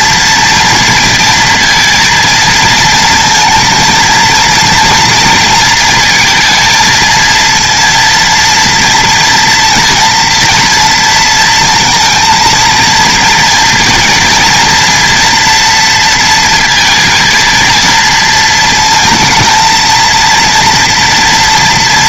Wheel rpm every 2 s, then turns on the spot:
230, 230, 230, 220, 230, 230, 230, 230, 230, 220, 230.
none